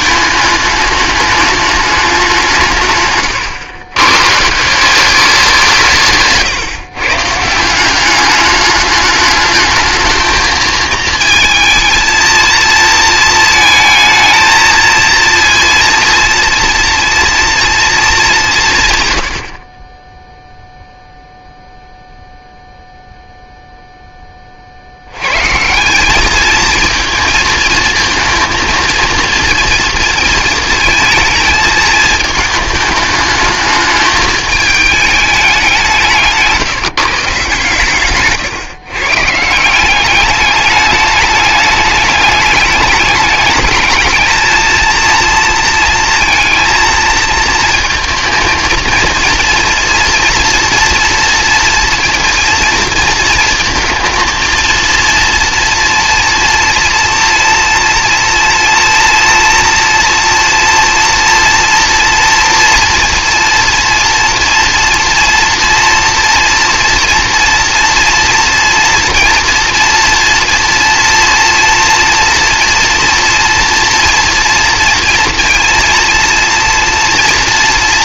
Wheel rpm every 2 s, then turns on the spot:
210, 160, 160, 160, 200, 220, 230, 230, 230, 160, 0, 0, 50, 220, 230, 230, 210, 210, 150, 140, 210, 210, 220, 230, 230, 240, 230, 230, 230, 230, 230, 230, 230, 230, 230, 240, 230, 230, 230.
none